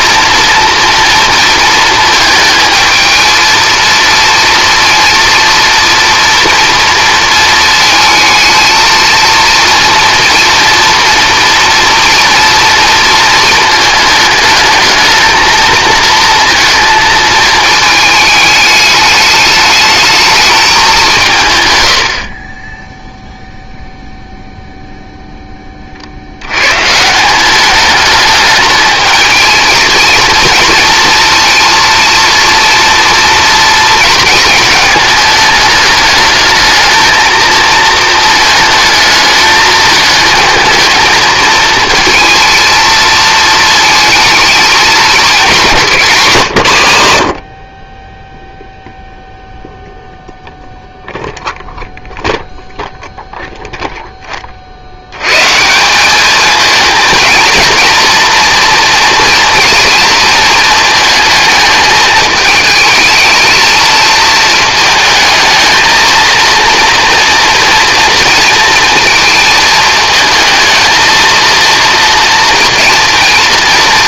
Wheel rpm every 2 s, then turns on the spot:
230, 220, 230, 230, 230, 230, 230, 220, 220, 210, 190, 10, 0, 110, 210, 230, 240, 220, 220, 220, 220, 220, 220, 120, 0, 0, 0, 60, 220, 230, 230, 220, 220, 230, 230, 230, 230.
none